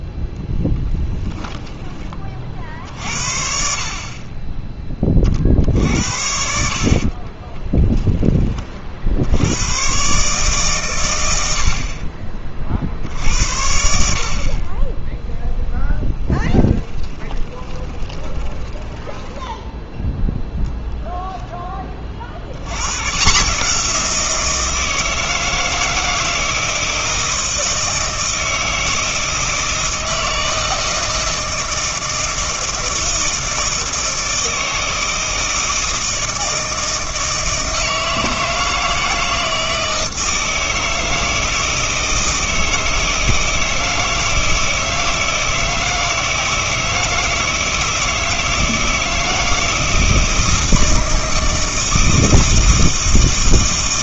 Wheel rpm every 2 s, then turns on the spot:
10, 50, 20, 60, 40, 140, 40, 40, 10, 20, 0, 90, 170, 160, 160, 160, 160, 160, 160, 160, 160, 160, 160, 160, 160, 160, 160.
0-2 16-20